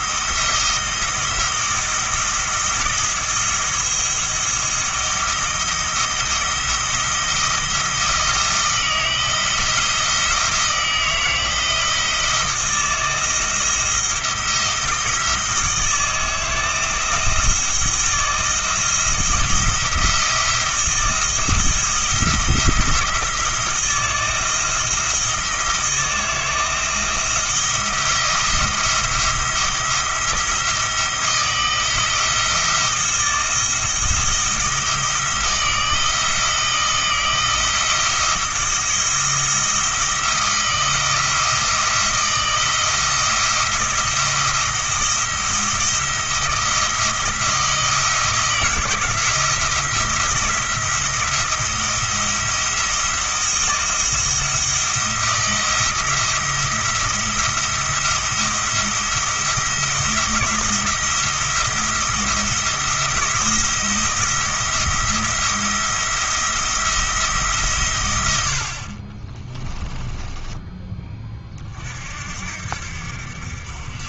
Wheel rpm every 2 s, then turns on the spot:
170, 170, 160, 170, 170, 160, 160, 160, 160, 160, 170, 170, 170, 160, 170, 170, 160, 160, 160, 170, 160, 170, 170, 160, 160, 160, 170, 170, 170, 170, 170, 170, 170, 170, 50, 20, 60.
none